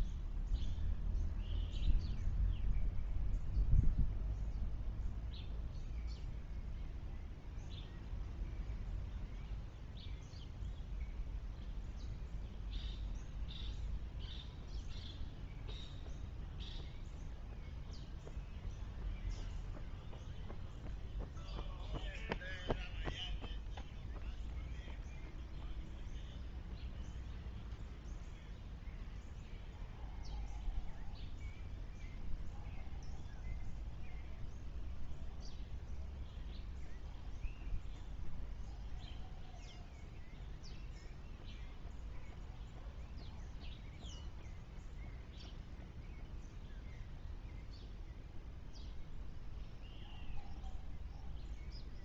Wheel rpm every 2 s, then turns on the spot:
0, 0, 0, 0, 0, 0, 0, 0, 0, 0, 0, 0, 0, 0, 0, 0, 0, 0, 0, 0, 0, 0, 0, 0, 0, 0.
none